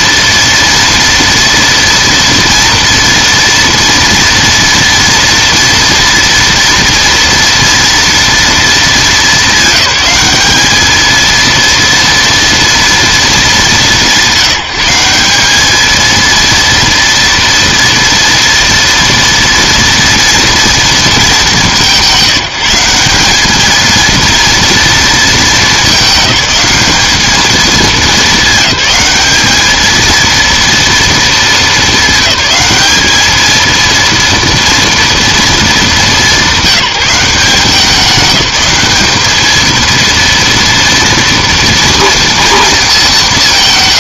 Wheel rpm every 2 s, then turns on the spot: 230, 230, 230, 230, 220, 210, 230, 180, 230, 230, 230, 170, 230, 200, 210, 230, 210, 230, 200, 210, 230, 220.
none